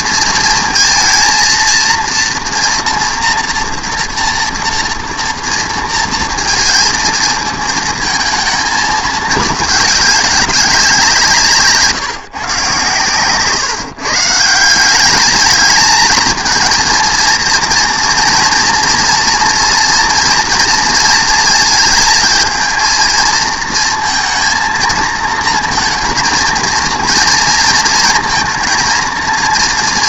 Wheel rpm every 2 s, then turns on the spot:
230, 230, 230, 230, 220, 180, 130, 170, 230, 230, 230, 230, 230, 230, 230.
none